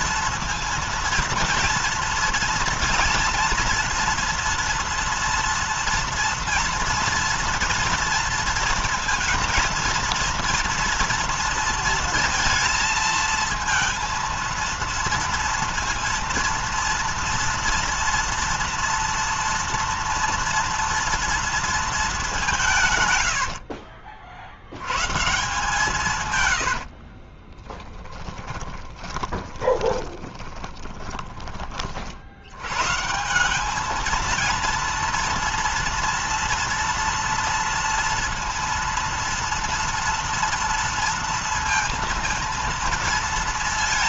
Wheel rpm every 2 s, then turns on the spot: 230, 230, 230, 230, 230, 230, 230, 230, 230, 230, 230, 180, 70, 90, 20, 20, 90, 230, 230, 230, 230, 230.
26-32